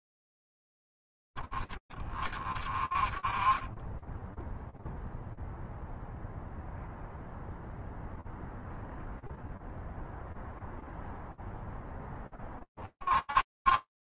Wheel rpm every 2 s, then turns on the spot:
30, 30, 0, 0, 0, 0, 30.
none